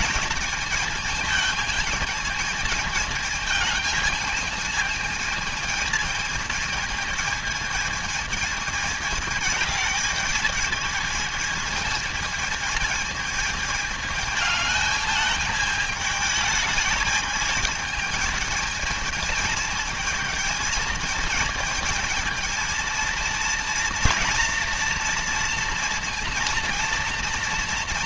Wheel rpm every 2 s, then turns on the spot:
220, 220, 220, 220, 220, 220, 220, 220, 210, 220, 220, 230, 230, 230.
none